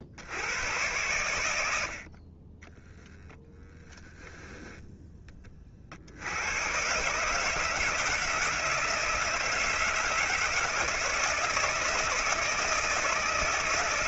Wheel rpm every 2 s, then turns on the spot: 90, 0, 10, 130, 160, 160, 160.
none